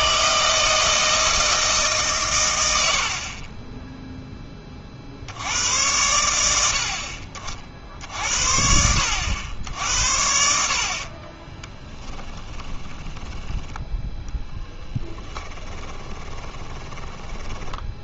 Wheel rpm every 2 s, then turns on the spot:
160, 100, 30, 80, 60, 70, 20, 10, 20.
12-14 16-18